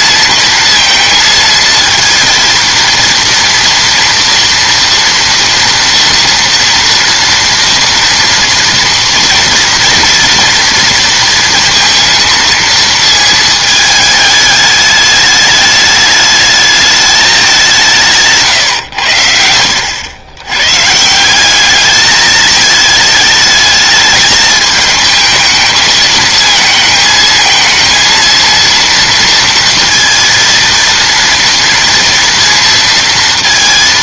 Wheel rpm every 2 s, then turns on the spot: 230, 230, 230, 230, 230, 230, 220, 210, 210, 130, 130, 220, 220, 220, 230, 230, 230.
none